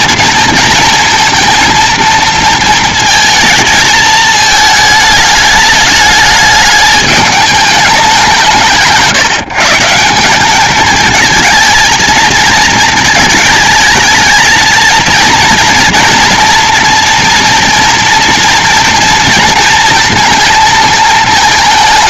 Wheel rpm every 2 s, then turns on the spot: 230, 230, 220, 210, 160, 210, 220, 220, 230, 230, 220.
none